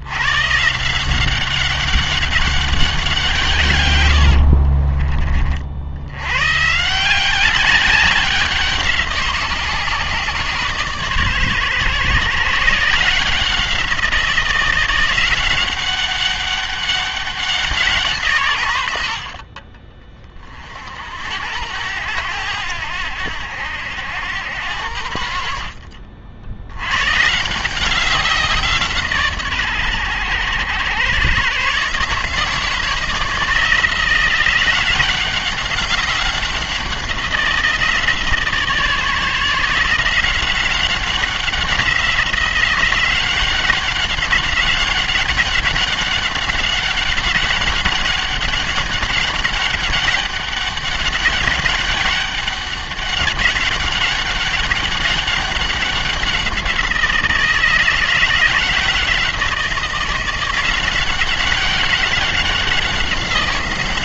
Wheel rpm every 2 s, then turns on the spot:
160, 190, 30, 150, 180, 140, 150, 180, 200, 100, 50, 90, 80, 100, 160, 100, 160, 180, 180, 150, 190, 180, 190, 200, 190, 200, 200, 200, 180, 170, 180, 190.
4-6